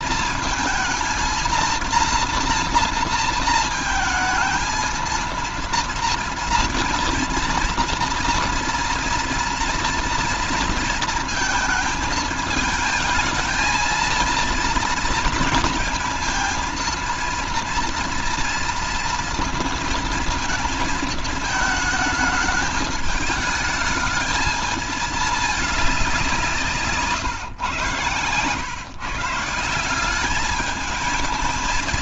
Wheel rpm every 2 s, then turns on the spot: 220, 230, 230, 230, 230, 230, 220, 230, 230, 230, 220, 220, 210, 160, 130, 210.
26-28